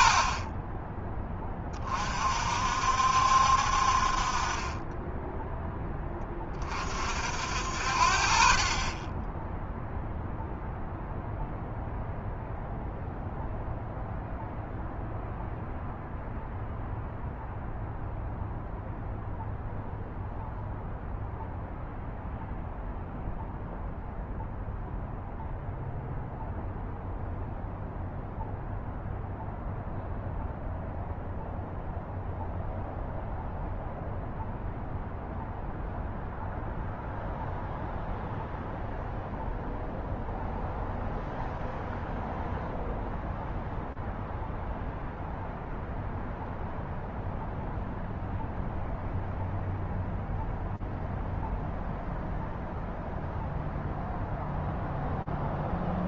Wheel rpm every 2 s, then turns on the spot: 40, 50, 40, 30, 40, 0, 0, 0, 0, 0, 0, 0, 0, 0, 0, 0, 0, 0, 0, 0, 0, 0, 0, 0, 0, 0, 0, 0.
none